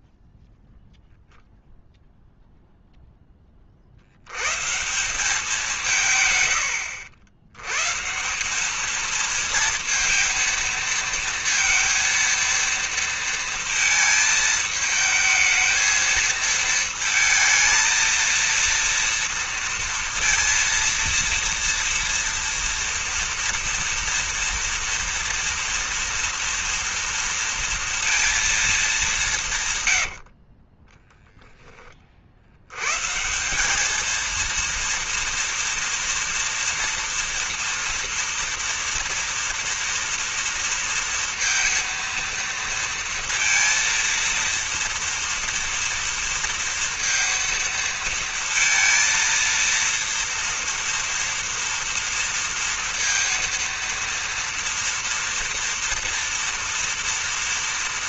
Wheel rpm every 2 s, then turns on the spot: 0, 20, 190, 90, 220, 230, 230, 220, 230, 230, 230, 230, 230, 230, 170, 0, 150, 230, 240, 240, 230, 230, 230, 230, 230, 230, 230, 230, 230.
none